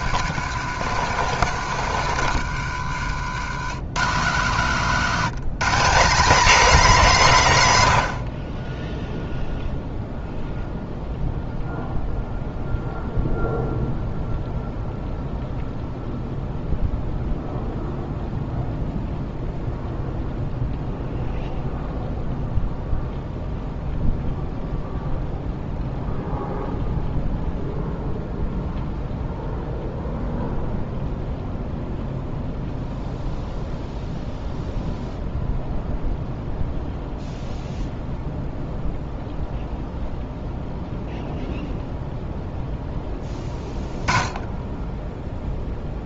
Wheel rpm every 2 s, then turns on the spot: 120, 90, 150, 200, 10, 0, 0, 0, 0, 0, 0, 0, 0, 0, 0, 0, 0, 0, 0, 0, 0, 10, 0.
0-4